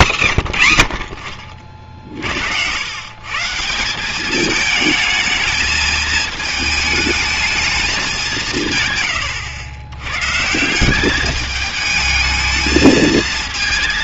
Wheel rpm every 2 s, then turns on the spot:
110, 100, 210, 220, 150, 180, 220.
none